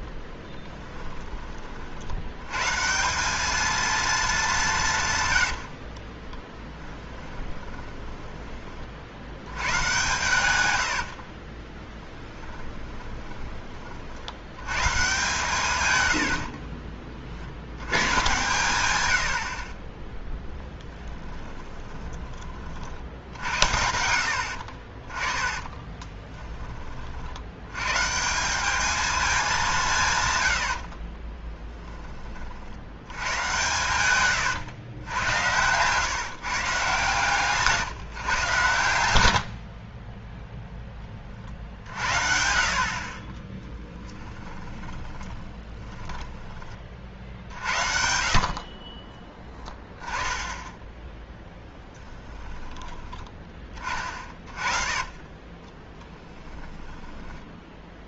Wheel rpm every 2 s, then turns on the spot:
10, 130, 190, 10, 30, 110, 10, 120, 40, 110, 10, 50, 40, 20, 200, 80, 60, 120, 150, 110, 10, 60, 10, 20, 40, 10, 10, 20, 10.
0-2 6-8 10-14 16-18 20-22 24-26 30-32 44-46 54-58